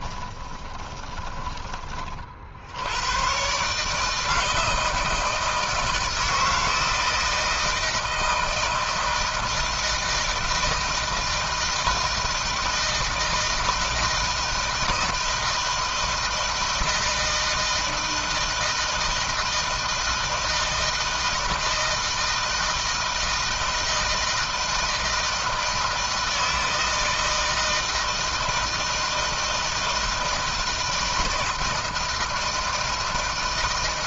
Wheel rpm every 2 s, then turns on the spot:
30, 60, 160, 160, 160, 160, 160, 160, 160, 160, 160, 160, 160, 160, 160, 160, 160.
0-2